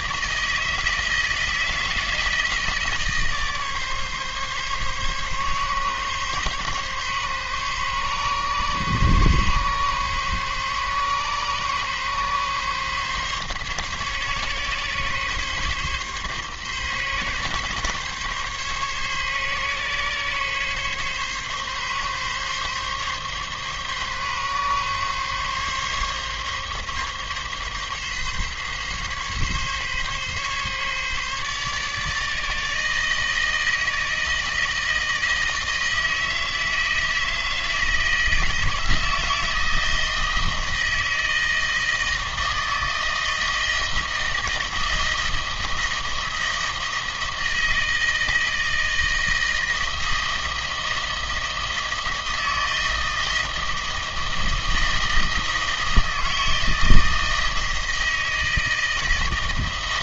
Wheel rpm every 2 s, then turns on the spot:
160, 160, 140, 140, 140, 140, 140, 140, 140, 140, 140, 140, 140, 140, 140, 140, 150, 160, 160, 160, 160, 160, 160, 160, 160, 160, 160, 160, 160, 160.
none